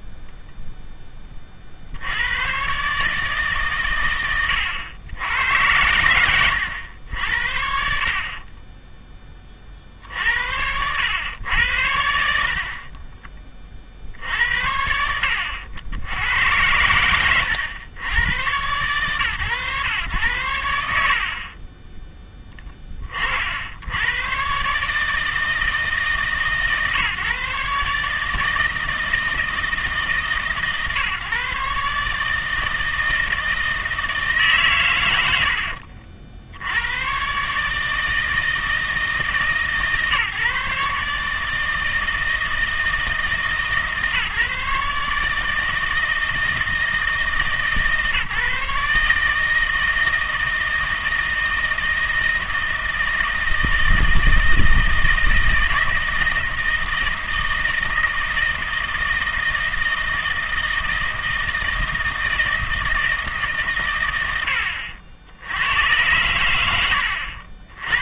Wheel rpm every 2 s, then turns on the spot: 0, 120, 100, 100, 20, 90, 30, 70, 100, 110, 70, 20, 130, 140, 160, 140, 160, 140, 80, 160, 140, 160, 150, 160, 150, 160, 160, 160, 160, 160, 160, 160, 80, 90.
8-10 12-14